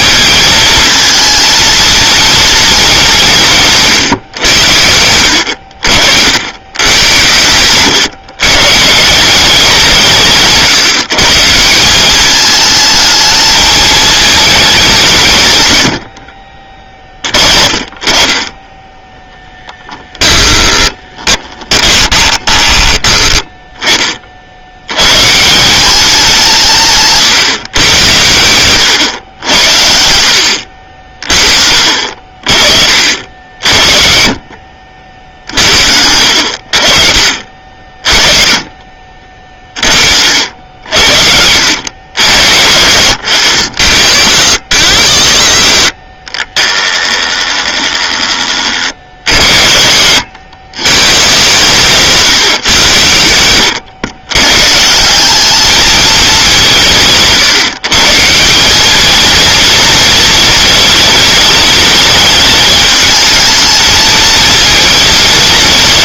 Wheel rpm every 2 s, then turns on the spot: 220, 200, 90, 100, 140, 160, 220, 190, 40, 20, 20, 20, 100, 150, 110, 60, 50, 50, 50, 30, 70, 80, 120, 20, 60, 130, 110, 160, 170, 200, 230, 220, 220.
20-24 30-32 38-40 46-48